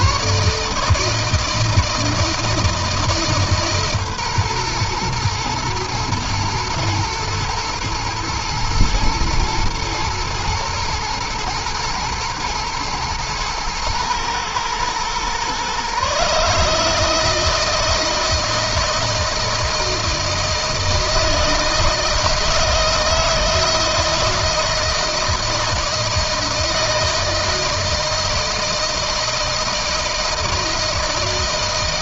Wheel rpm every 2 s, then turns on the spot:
150, 160, 120, 120, 120, 120, 110, 120, 150, 160, 160, 160, 160, 160, 160, 160.
none